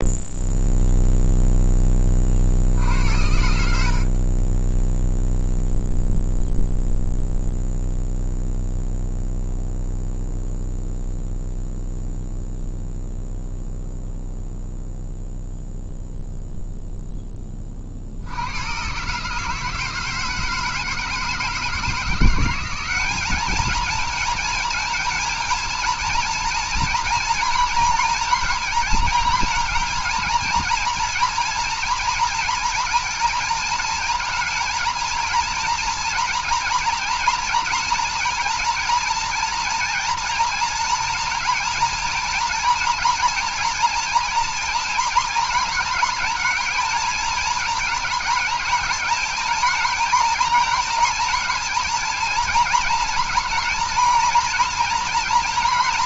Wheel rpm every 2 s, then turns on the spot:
0, 60, 20, 0, 0, 0, 0, 0, 0, 110, 160, 190, 220, 230, 230, 230, 230, 220, 240, 230, 230, 230, 230, 230, 220, 230, 230, 230.
none